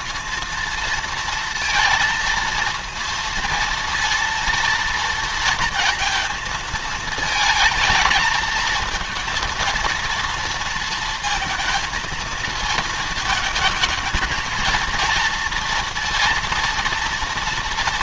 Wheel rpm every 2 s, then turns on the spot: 230, 230, 230, 220, 220, 230, 220, 230, 230.
none